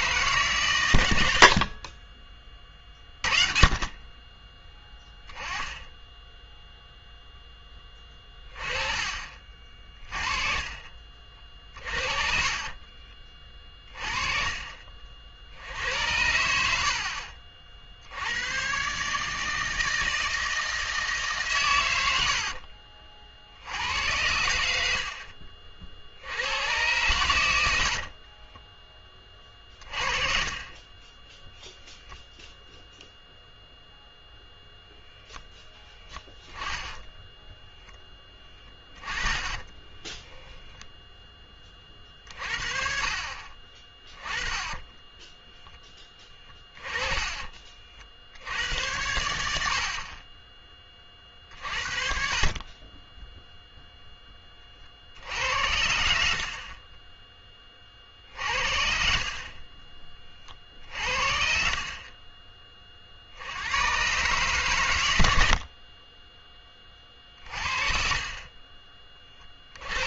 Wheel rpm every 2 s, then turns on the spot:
130, 30, 10, 0, 30, 40, 30, 40, 60, 130, 160, 60, 70, 100, 20, 30, 0, 0, 10, 10, 0, 50, 20, 20, 80, 20, 30, 40, 40, 60, 50, 30, 120, 20, 30.
4-6 12-14 22-24 38-40 44-48 58-60 66-70